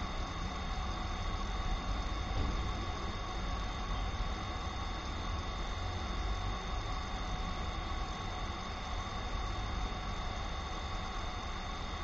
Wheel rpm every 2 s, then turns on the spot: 0, 0, 0, 0, 0, 0.
none